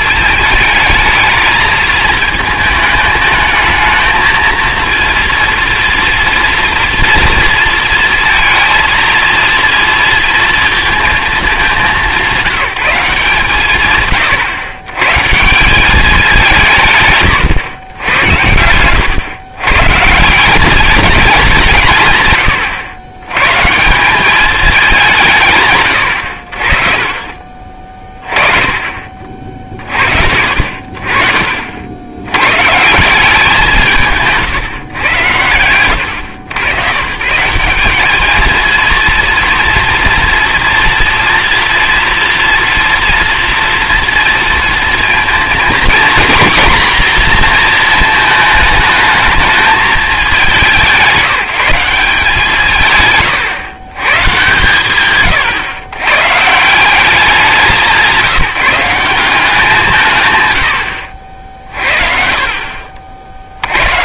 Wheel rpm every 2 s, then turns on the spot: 220, 220, 230, 240, 230, 230, 190, 120, 170, 100, 200, 90, 210, 40, 30, 50, 140, 140, 110, 230, 230, 230, 230, 240, 210, 180, 160, 130, 180, 170, 90, 50.
60-62